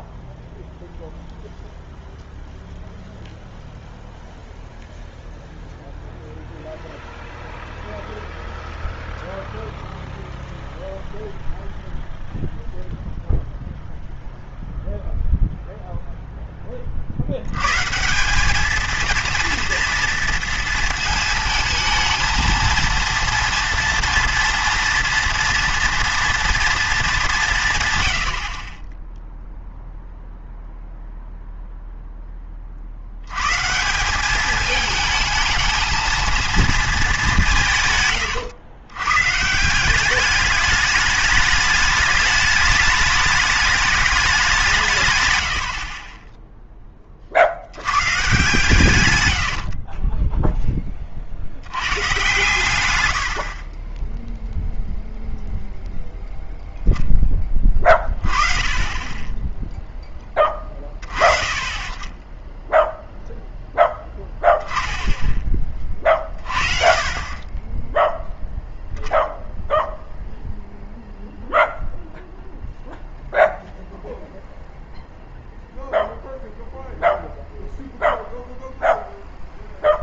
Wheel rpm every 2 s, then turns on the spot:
0, 0, 0, 0, 0, 0, 0, 0, 20, 220, 230, 230, 230, 230, 30, 0, 40, 210, 230, 110, 210, 210, 180, 10, 120, 10, 120, 0, 0, 20, 30, 0, 10, 40, 0, 0, 0, 0, 0, 0.
none